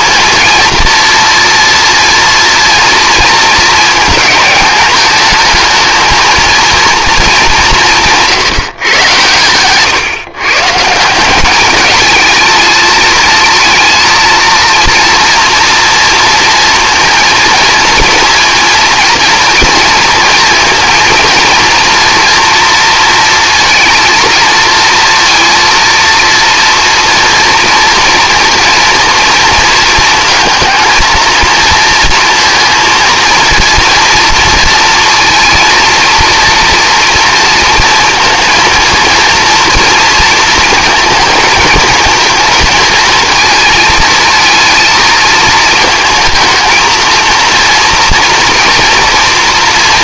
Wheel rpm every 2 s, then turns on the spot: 230, 230, 220, 230, 140, 140, 220, 230, 230, 230, 230, 230, 230, 240, 230, 220, 230, 230, 240, 230, 230, 230, 230, 230, 230.
none